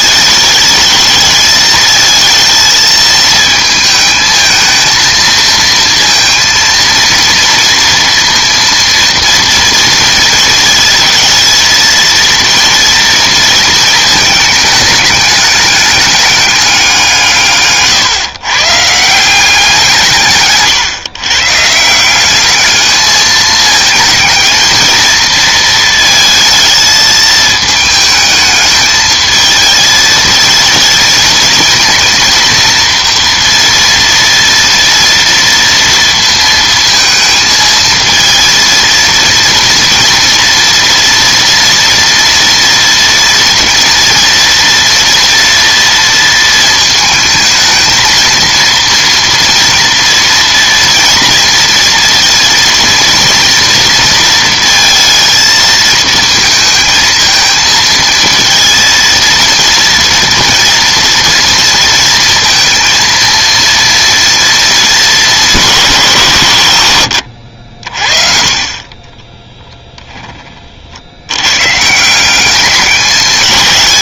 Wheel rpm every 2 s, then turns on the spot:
220, 220, 220, 230, 230, 220, 230, 210, 190, 150, 130, 210, 220, 220, 220, 230, 230, 230, 220, 230, 230, 230, 230, 220, 230, 230, 230, 230, 220, 230, 230, 230, 230, 110, 30, 70, 200.
68-70